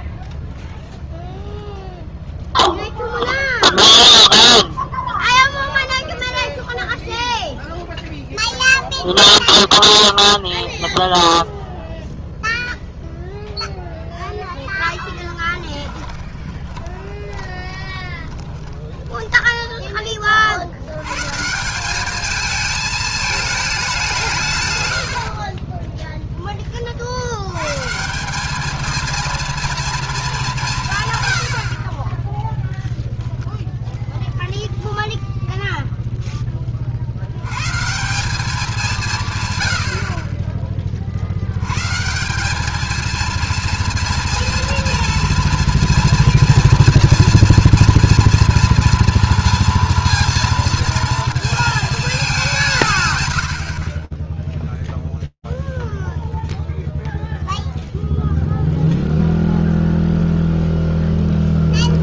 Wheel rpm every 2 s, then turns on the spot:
0, 0, 0, 0, 0, 0, 0, 20, 20, 20, 200, 170, 0, 180, 220, 20, 0, 0, 120, 120, 90, 230, 230, 240, 230, 220, 70, 0, 0, 0, 10.
14-18 60-62